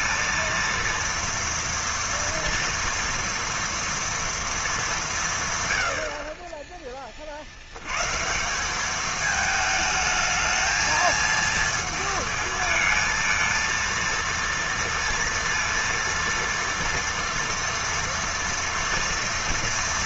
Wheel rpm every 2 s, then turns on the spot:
230, 230, 230, 40, 180, 220, 220, 230, 230, 230.
none